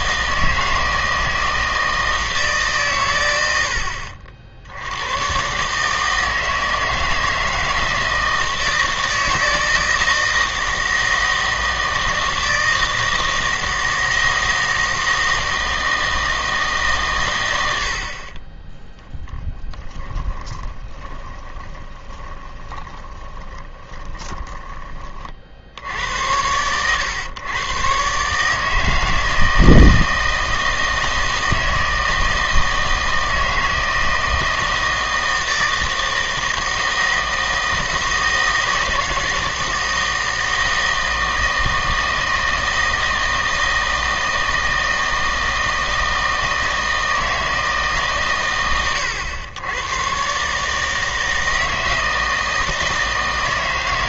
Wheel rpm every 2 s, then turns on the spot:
160, 140, 70, 160, 160, 160, 160, 160, 150, 10, 20, 20, 20, 110, 160, 160, 160, 160, 160, 160, 160, 160, 160, 160, 110, 150, 160.
20-24